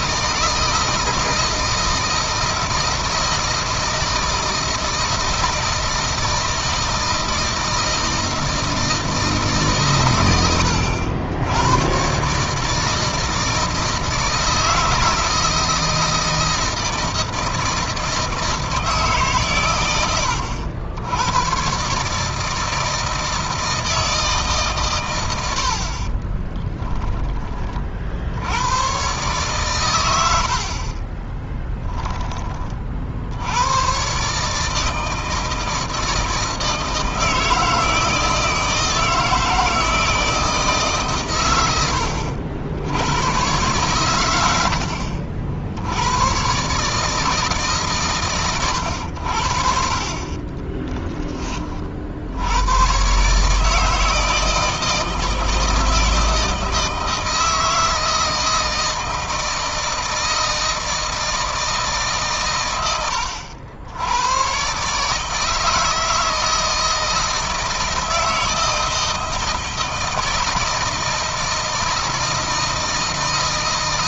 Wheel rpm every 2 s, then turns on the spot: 160, 160, 160, 160, 160, 90, 150, 170, 160, 160, 100, 160, 130, 10, 110, 60, 30, 150, 160, 160, 150, 90, 80, 130, 110, 20, 100, 160, 160, 160, 160, 110, 130, 160, 160, 160, 160.
26-28 30-32 50-52